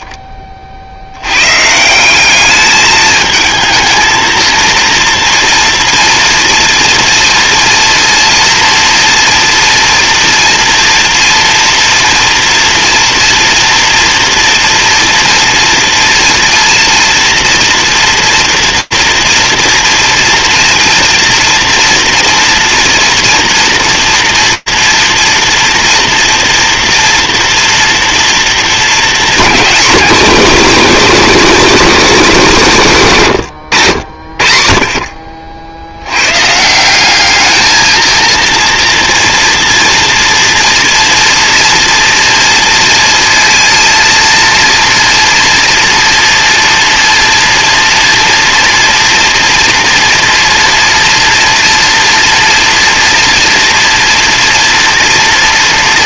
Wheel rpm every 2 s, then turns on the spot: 10, 200, 230, 230, 230, 230, 230, 230, 230, 230, 240, 230, 230, 230, 230, 250, 200, 60, 180, 240, 230, 230, 230, 230, 230, 230, 240, 230.
none